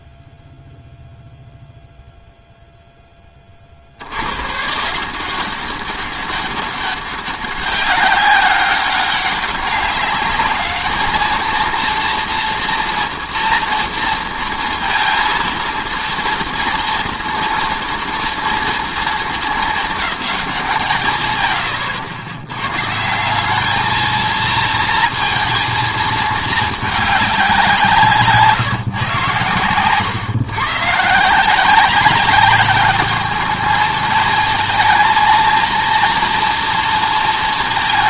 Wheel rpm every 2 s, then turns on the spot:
0, 10, 170, 200, 200, 220, 230, 230, 230, 220, 130, 190, 230, 190, 120, 160, 210, 230, 230.
none